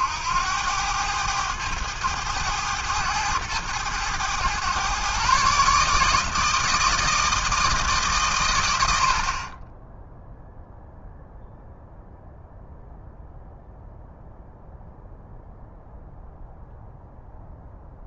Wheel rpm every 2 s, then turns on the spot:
80, 110, 120, 160, 110, 0, 0, 0, 0.
none